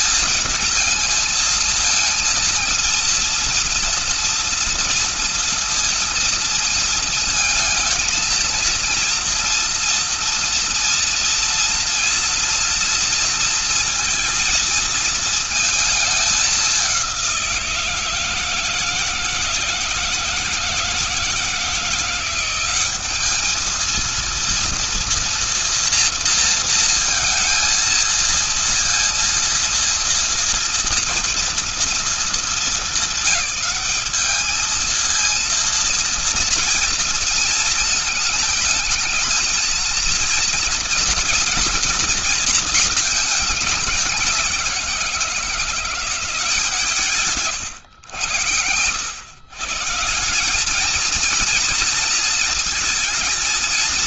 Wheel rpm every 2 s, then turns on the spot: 220, 220, 230, 230, 230, 230, 230, 230, 210, 160, 160, 180, 230, 230, 230, 240, 220, 210, 230, 230, 230, 230, 190, 170, 100, 180, 230.
none